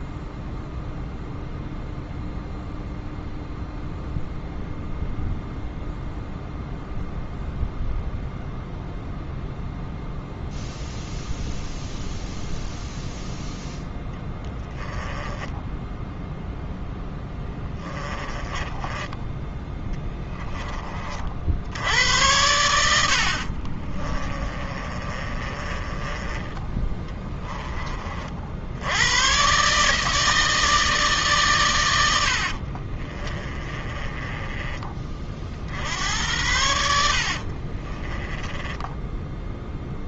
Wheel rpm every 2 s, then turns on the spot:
0, 0, 0, 0, 0, 0, 0, 10, 0, 10, 30, 80, 30, 10, 80, 150, 40, 30, 80, 10.
14-16 18-20 24-26 32-34 36-40